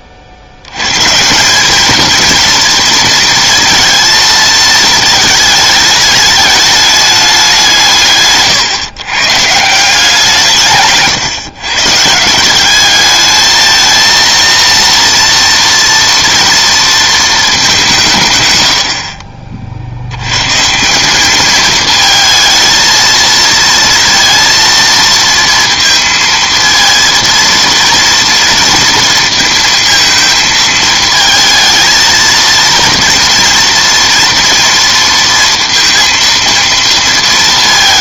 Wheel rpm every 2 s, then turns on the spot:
90, 230, 220, 210, 130, 150, 190, 230, 230, 100, 150, 230, 230, 230, 230, 220, 230, 230, 230.
none